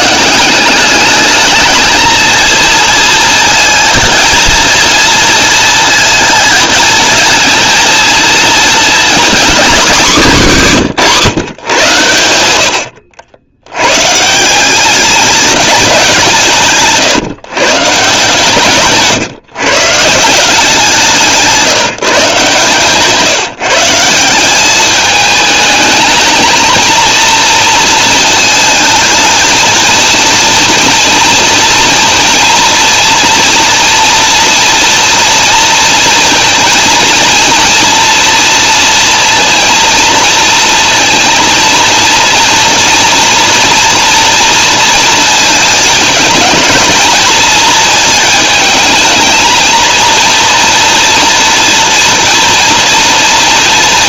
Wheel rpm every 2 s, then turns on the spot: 200, 230, 230, 220, 230, 180, 90, 180, 150, 160, 190, 160, 200, 230, 220, 230, 230, 230, 230, 230, 230, 230, 230, 230, 220, 230, 230.
none